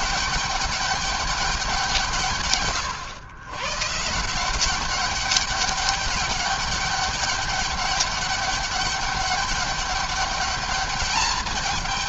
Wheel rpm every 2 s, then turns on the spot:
200, 120, 190, 200, 200, 210.
none